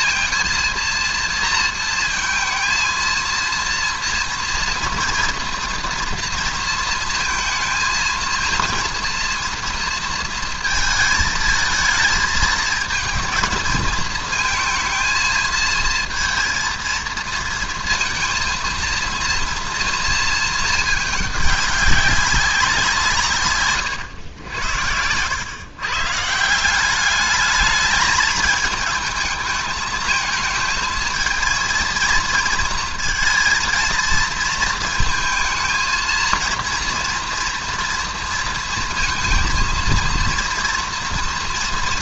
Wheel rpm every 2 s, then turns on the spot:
230, 230, 230, 230, 230, 230, 220, 220, 230, 230, 220, 190, 90, 170, 210, 220, 230, 220, 220, 230, 230.
none